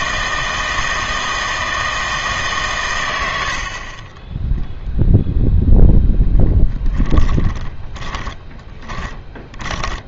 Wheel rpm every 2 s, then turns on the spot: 160, 130, 0, 10, 10.
6-10